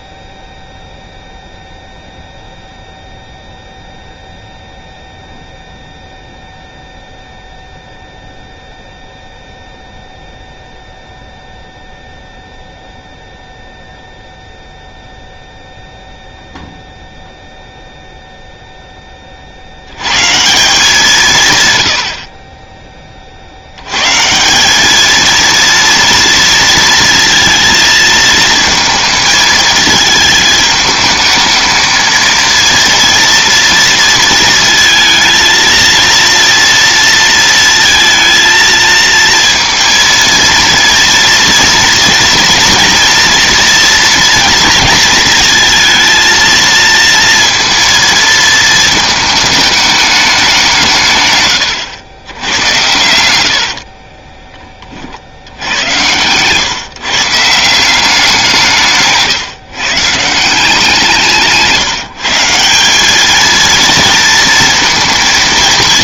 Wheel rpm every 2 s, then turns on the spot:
0, 0, 0, 0, 0, 0, 0, 0, 0, 10, 170, 30, 200, 230, 230, 210, 230, 230, 230, 230, 230, 230, 230, 230, 220, 170, 100, 30, 140, 150, 170, 180, 230.
22-24